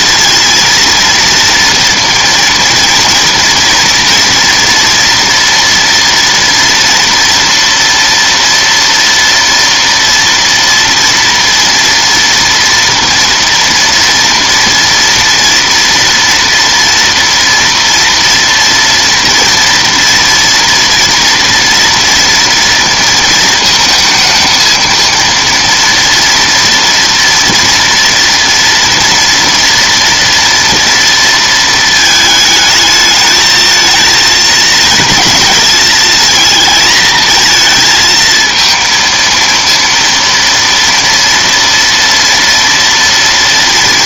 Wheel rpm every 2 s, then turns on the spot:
230, 230, 240, 230, 230, 230, 230, 230, 230, 240, 230, 230, 230, 230, 230, 230, 210, 220, 230, 230, 230, 230.
none